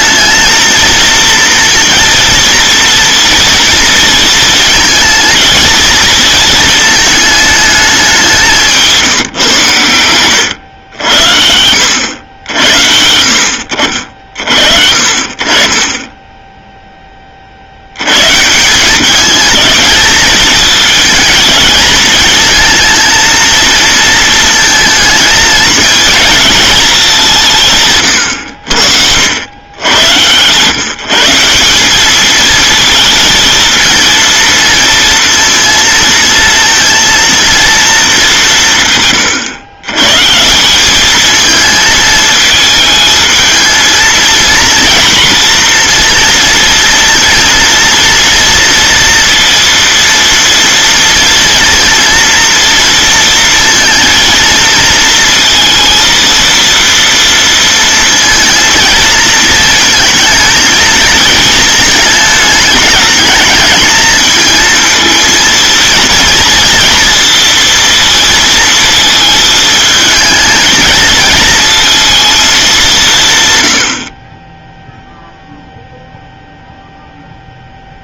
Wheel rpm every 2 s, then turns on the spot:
230, 230, 230, 230, 170, 110, 70, 50, 10, 160, 220, 230, 220, 220, 80, 120, 220, 230, 230, 170, 190, 220, 230, 230, 230, 230, 230, 230, 230, 230, 230, 210, 220, 230, 230, 220, 200, 10, 0.
8-10